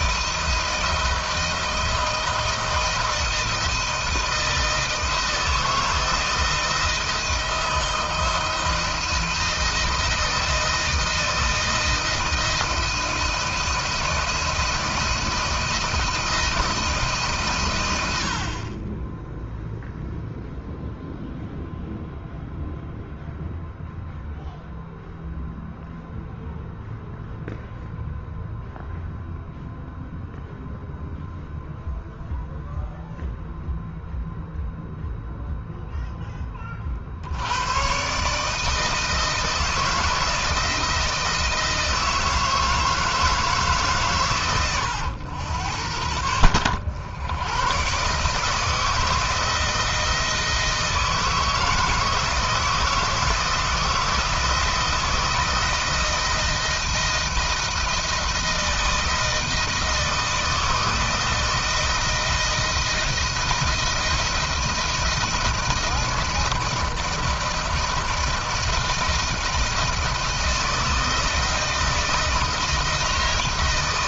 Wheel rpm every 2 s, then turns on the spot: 170, 160, 160, 160, 160, 160, 160, 160, 160, 40, 0, 0, 0, 0, 0, 0, 0, 0, 30, 160, 170, 160, 110, 100, 160, 160, 160, 160, 160, 170, 160, 160, 160, 160, 160, 160, 160.
none